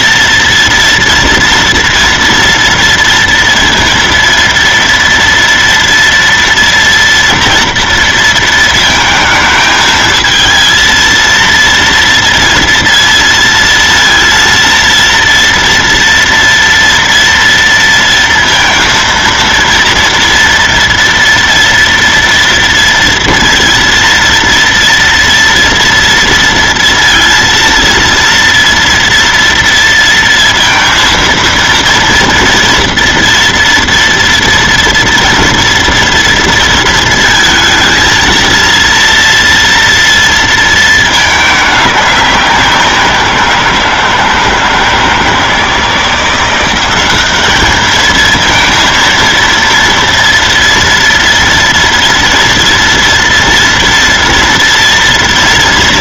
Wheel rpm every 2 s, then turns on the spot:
230, 230, 230, 230, 220, 230, 230, 230, 230, 230, 230, 230, 230, 230, 230, 230, 230, 230, 230, 230, 220, 180, 160, 190, 230, 230, 230, 230.
none